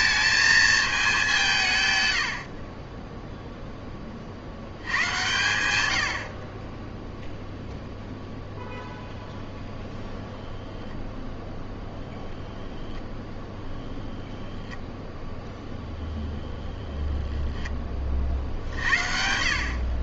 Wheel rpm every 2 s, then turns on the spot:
220, 30, 90, 10, 0, 0, 0, 0, 10, 60.
none